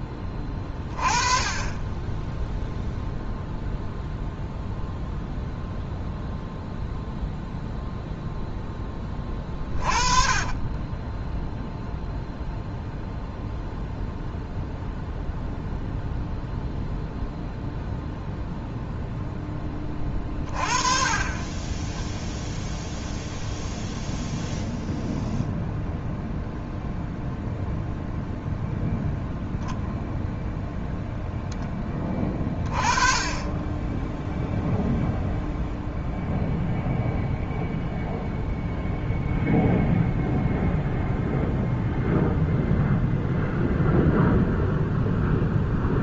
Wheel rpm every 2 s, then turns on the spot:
20, 0, 0, 0, 20, 20, 0, 0, 0, 0, 30, 0, 0, 0, 0, 0, 30, 0, 0, 0, 0, 0, 0.
10-12